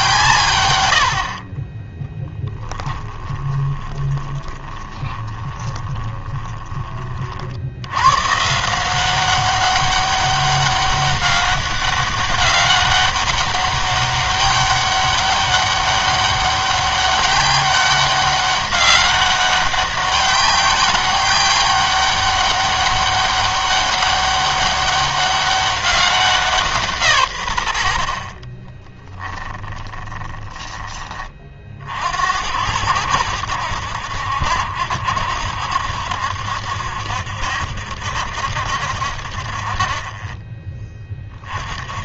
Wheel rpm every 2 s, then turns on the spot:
110, 20, 20, 30, 170, 200, 200, 200, 200, 200, 200, 200, 200, 170, 20, 20, 90, 70, 70, 70, 30.
2-6 28-30